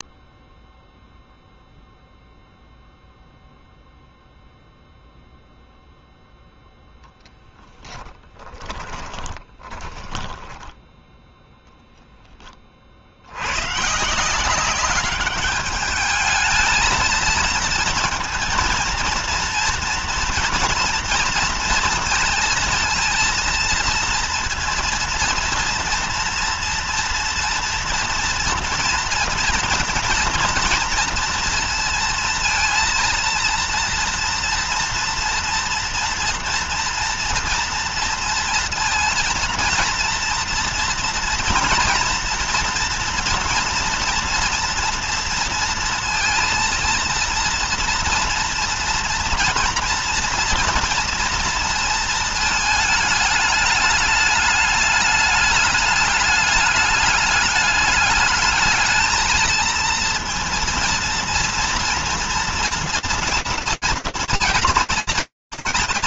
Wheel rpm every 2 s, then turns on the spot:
0, 0, 0, 0, 10, 10, 20, 180, 220, 230, 230, 230, 230, 230, 240, 230, 230, 230, 230, 230, 230, 230, 230, 230, 230, 230, 220, 210, 210, 210, 230, 230, 200.
8-12